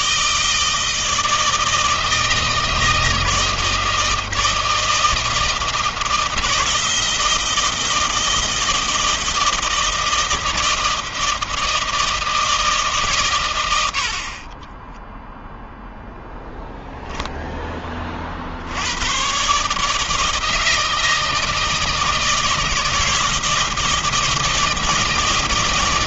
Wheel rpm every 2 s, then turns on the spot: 160, 160, 160, 160, 160, 160, 160, 50, 0, 50, 160, 160, 160.
14-16